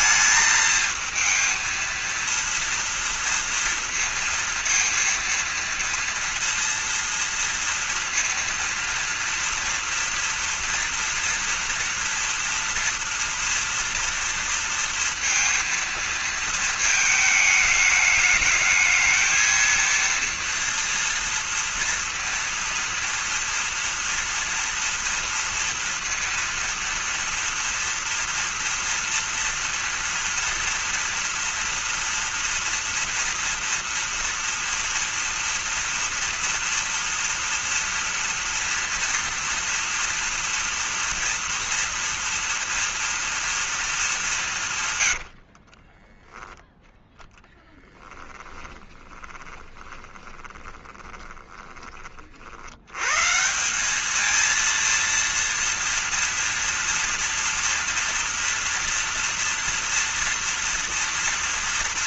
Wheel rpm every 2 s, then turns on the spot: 220, 230, 230, 230, 230, 230, 230, 230, 220, 220, 230, 230, 230, 230, 230, 230, 230, 230, 230, 240, 240, 230, 180, 10, 10, 10, 60, 220, 240, 240, 230.
46-52